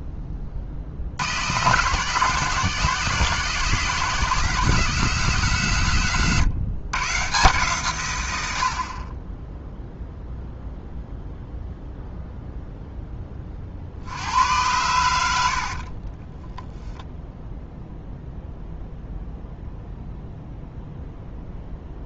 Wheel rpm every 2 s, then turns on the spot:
50, 170, 180, 140, 60, 0, 0, 100, 0, 0, 0.
none